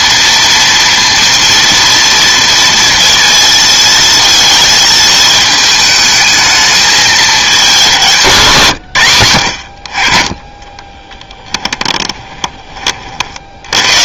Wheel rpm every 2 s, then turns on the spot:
230, 230, 220, 210, 90, 10, 60.
10-12